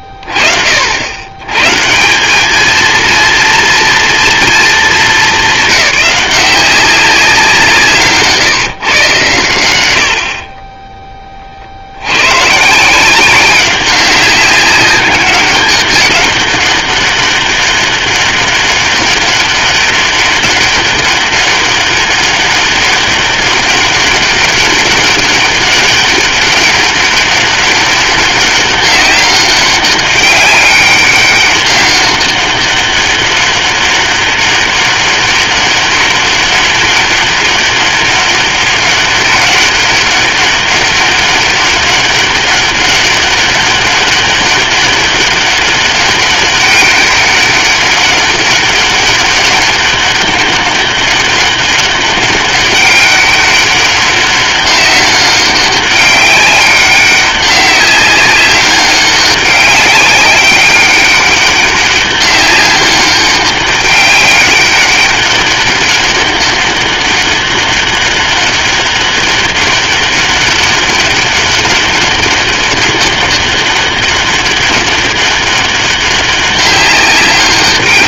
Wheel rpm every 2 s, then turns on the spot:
40, 230, 230, 190, 150, 20, 170, 200, 200, 200, 200, 200, 200, 200, 200, 200, 200, 200, 200, 190, 200, 200, 200, 200, 200, 200, 200, 190, 200, 200, 200, 200, 200, 200, 200, 200, 200, 200, 190.
none